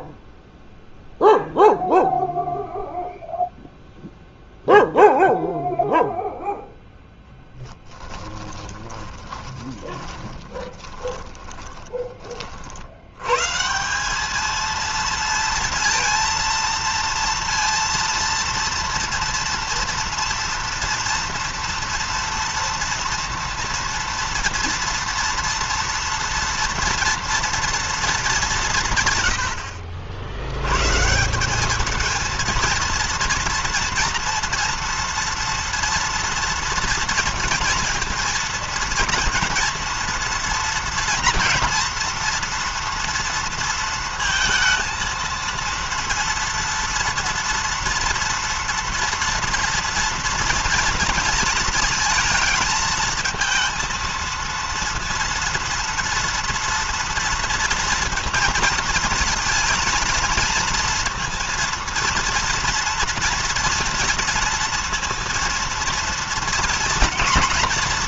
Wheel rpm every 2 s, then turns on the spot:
0, 0, 0, 0, 10, 20, 50, 220, 230, 230, 230, 230, 230, 230, 180, 100, 230, 230, 230, 230, 230, 230, 230, 230, 230, 230, 220, 230, 230, 230, 230, 230, 230, 230.
8-12